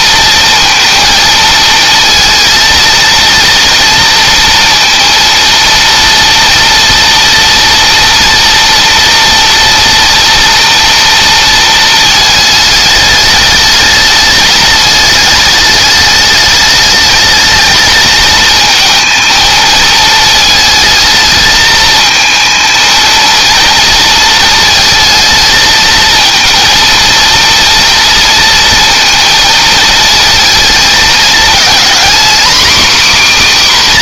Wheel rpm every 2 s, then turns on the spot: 230, 230, 230, 230, 230, 230, 210, 210, 210, 230, 220, 230, 220, 220, 230, 220, 270.
none